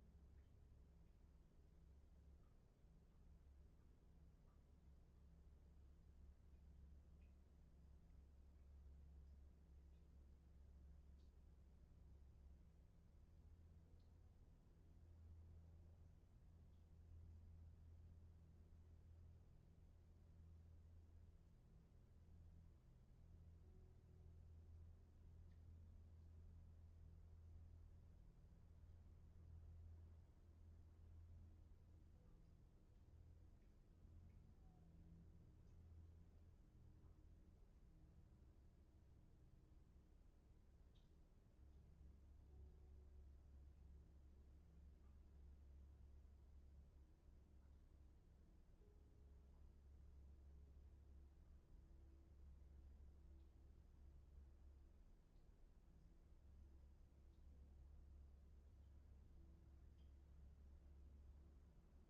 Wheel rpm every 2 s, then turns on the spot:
0, 0, 0, 0, 0, 0, 0, 0, 0, 0, 0, 0, 0, 0, 0, 0, 0, 0, 0, 0, 0, 0, 0, 0, 0, 0, 0, 0, 0, 0, 0.
none